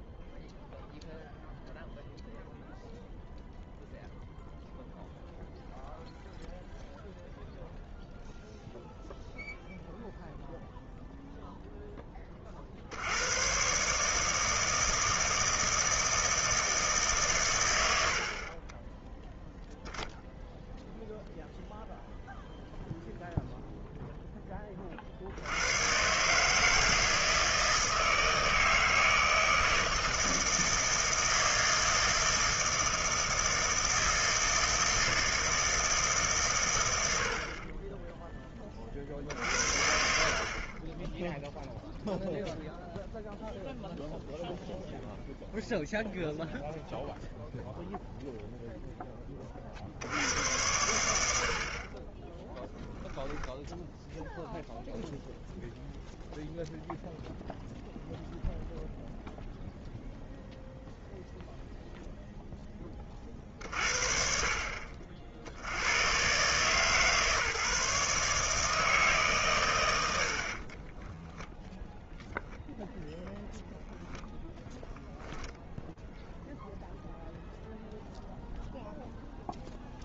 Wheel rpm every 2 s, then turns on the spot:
0, 0, 0, 0, 0, 0, 70, 160, 150, 20, 0, 0, 40, 160, 160, 160, 160, 160, 100, 20, 40, 0, 0, 0, 0, 90, 10, 0, 0, 0, 0, 10, 50, 130, 160, 60, 0, 0, 0, 0.
70-72